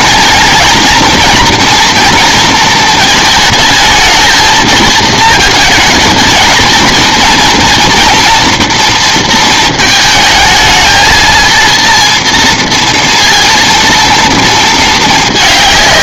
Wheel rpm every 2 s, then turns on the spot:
230, 230, 220, 230, 230, 220, 230, 220.
none